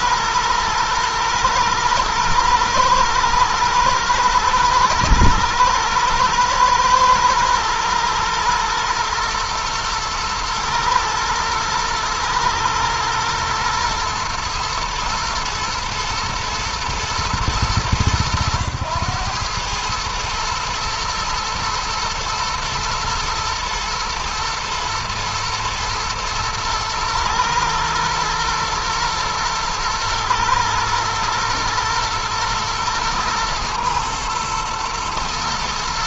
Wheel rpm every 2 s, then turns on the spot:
110, 110, 110, 110, 110, 110, 110, 110, 110, 100, 110, 110, 120, 110, 110, 110, 110, 120.
none